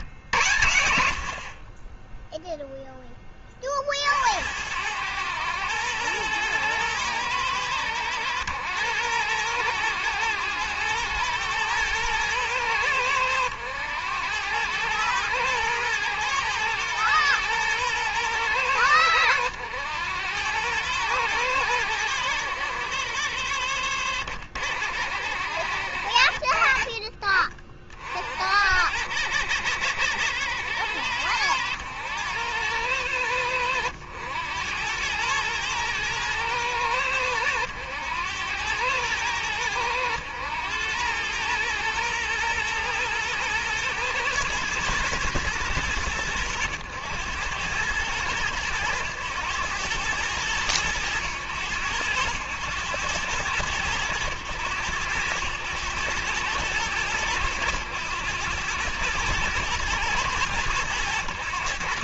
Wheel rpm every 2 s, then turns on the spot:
90, 0, 80, 110, 110, 110, 100, 100, 110, 100, 100, 80, 80, 50, 80, 90, 90, 100, 110, 100, 100, 110, 120, 110, 110, 110, 100, 100, 110, 110, 110.
none